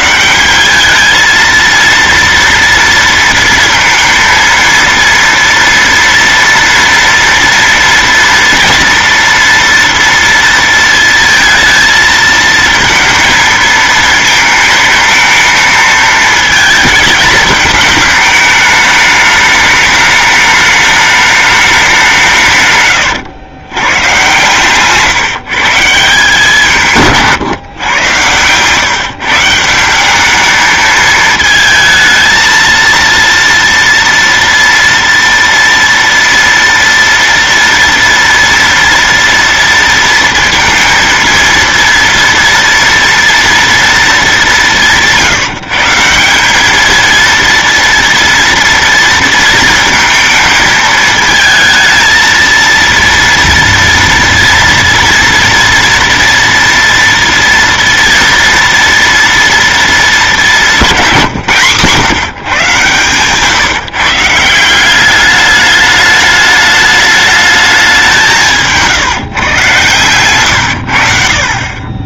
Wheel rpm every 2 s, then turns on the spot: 190, 230, 230, 230, 230, 230, 220, 220, 220, 210, 210, 140, 130, 160, 130, 210, 220, 230, 230, 230, 230, 230, 190, 200, 230, 220, 230, 240, 230, 230, 200, 140, 170, 210, 160, 110.
none